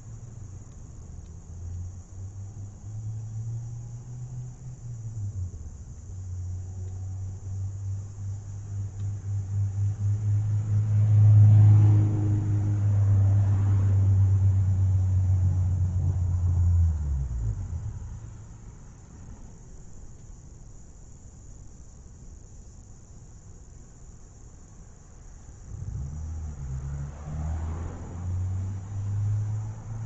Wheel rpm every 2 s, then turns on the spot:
0, 0, 0, 0, 0, 0, 0, 0, 0, 0, 0, 0, 0, 0, 0.
none